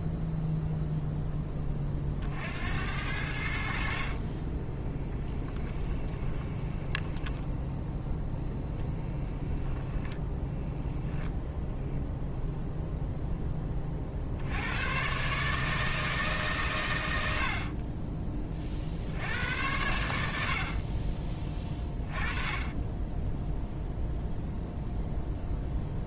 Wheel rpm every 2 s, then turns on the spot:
0, 80, 10, 10, 0, 0, 0, 100, 110, 50, 40, 10, 0.
4-8